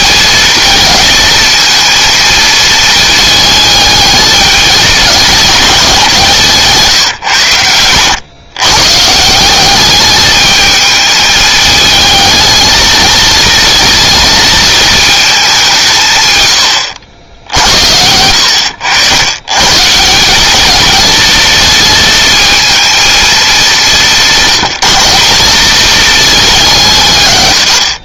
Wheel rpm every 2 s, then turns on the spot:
220, 220, 220, 140, 130, 210, 220, 230, 90, 90, 220, 230, 180, 180.
none